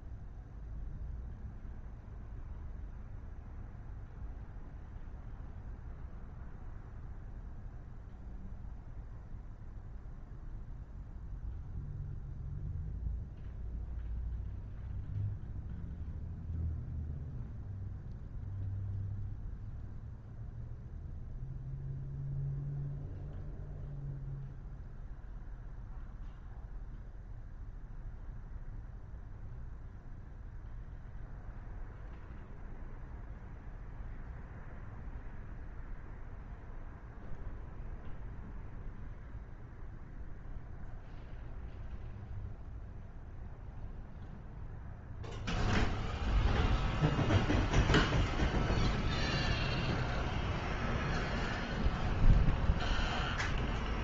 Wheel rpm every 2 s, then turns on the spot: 0, 0, 0, 0, 0, 0, 0, 0, 0, 0, 0, 0, 0, 0, 0, 0, 0, 0, 0, 0, 0, 0, 0, 0, 0, 0, 0.
none